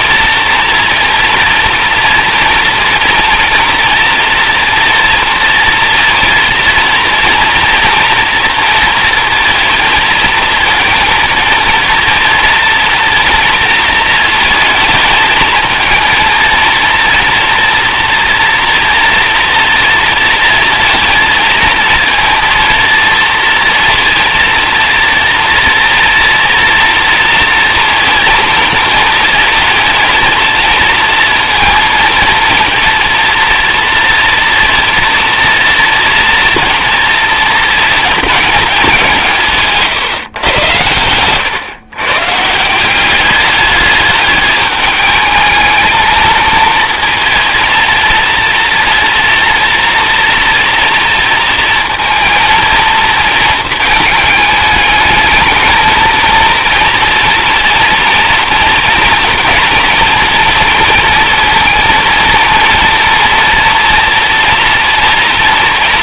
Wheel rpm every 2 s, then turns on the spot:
230, 230, 240, 230, 230, 230, 230, 230, 230, 230, 230, 230, 230, 230, 230, 220, 230, 230, 230, 210, 110, 140, 210, 220, 230, 230, 230, 220, 230, 230, 230, 230, 240.
none